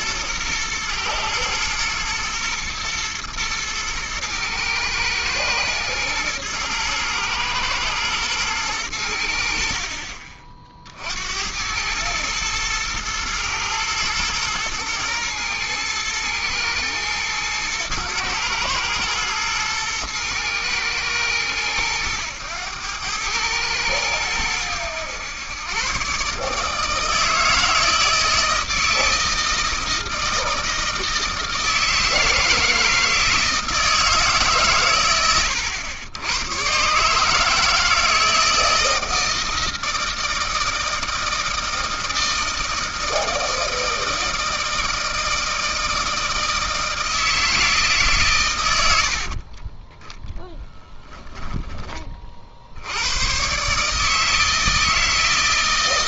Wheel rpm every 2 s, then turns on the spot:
110, 120, 110, 110, 100, 50, 110, 110, 110, 110, 110, 100, 100, 150, 160, 160, 160, 130, 120, 160, 160, 160, 160, 160, 90, 10, 70, 160.
48-52